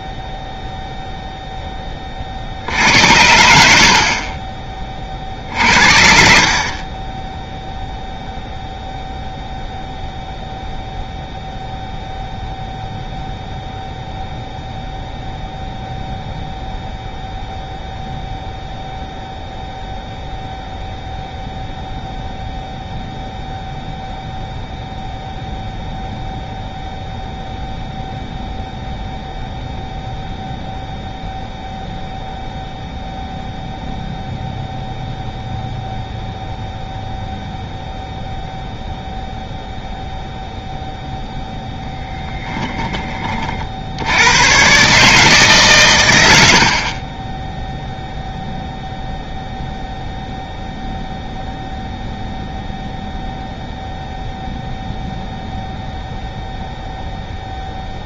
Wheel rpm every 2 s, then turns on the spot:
0, 60, 30, 50, 0, 0, 0, 0, 0, 0, 0, 0, 0, 0, 0, 0, 0, 0, 0, 0, 0, 20, 110, 70, 0, 0, 0, 0, 0.
42-44